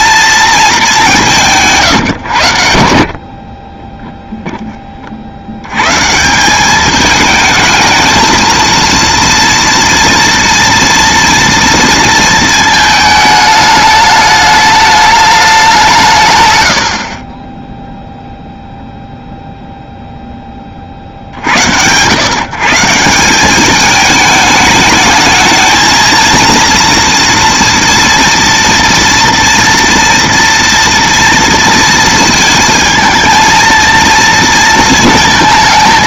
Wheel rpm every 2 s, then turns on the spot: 200, 70, 20, 210, 230, 230, 220, 210, 70, 0, 60, 160, 210, 230, 230, 230, 230, 220.
none